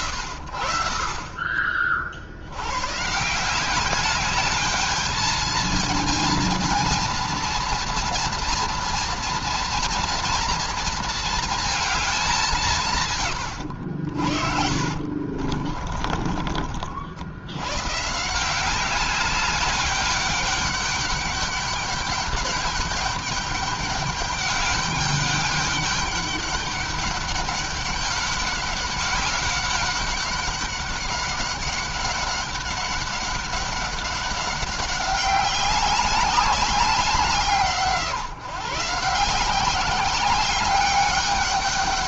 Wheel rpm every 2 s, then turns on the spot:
80, 80, 210, 230, 240, 230, 190, 60, 40, 170, 200, 200, 200, 200, 200, 200, 200, 200, 190, 150, 200.
14-16